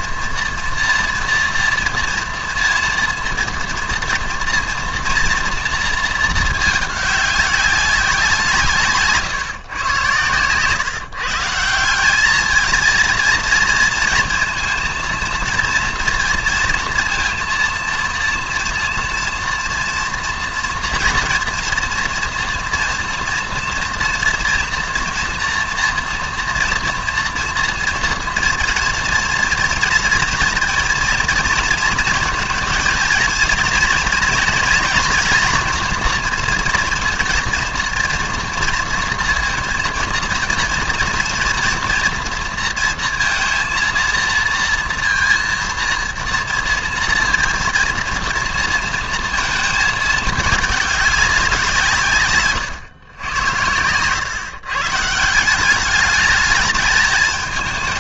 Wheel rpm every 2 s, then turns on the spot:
230, 230, 230, 210, 150, 140, 220, 230, 230, 230, 230, 240, 230, 240, 240, 230, 220, 240, 230, 230, 230, 230, 230, 230, 230, 210, 130, 140, 210.
none